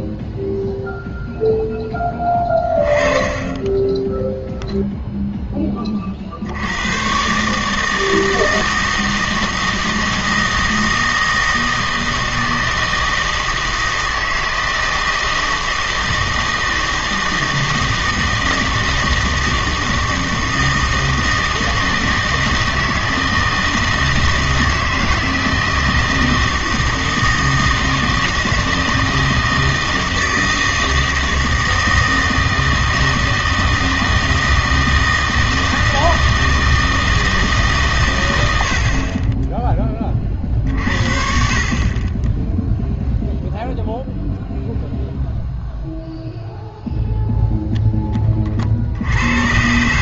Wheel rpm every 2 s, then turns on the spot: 0, 20, 0, 90, 160, 160, 160, 160, 160, 160, 160, 160, 160, 160, 160, 160, 160, 160, 160, 70, 50, 0, 0, 0, 50.
none